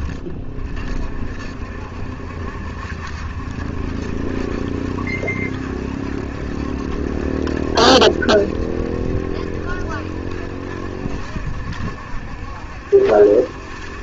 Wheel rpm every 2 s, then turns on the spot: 50, 70, 70, 70, 70, 70, 70.
none